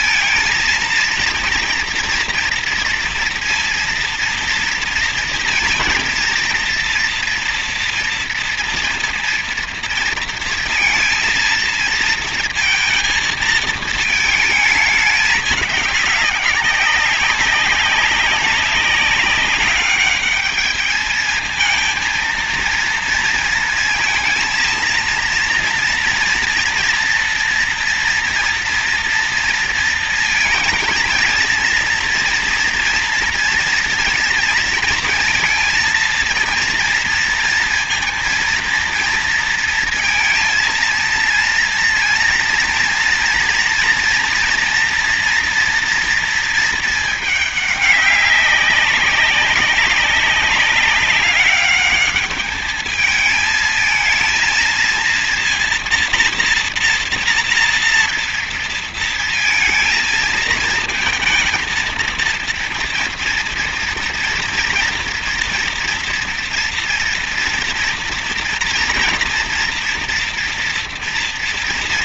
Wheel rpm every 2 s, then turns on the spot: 230, 230, 230, 230, 230, 230, 230, 210, 200, 200, 210, 230, 230, 240, 230, 220, 230, 230, 230, 230, 230, 240, 230, 220, 200, 200, 220, 230, 230, 230, 220, 230, 230, 230, 230, 230.
none